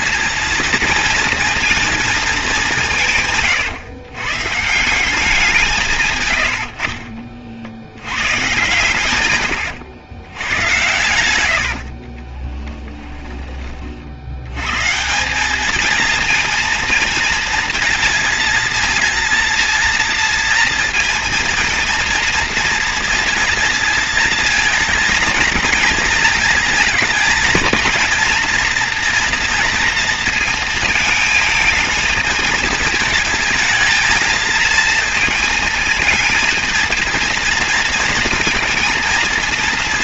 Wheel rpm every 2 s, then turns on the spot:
230, 200, 140, 100, 130, 110, 30, 90, 220, 230, 230, 230, 230, 220, 230, 230, 220, 230, 230, 230.
12-14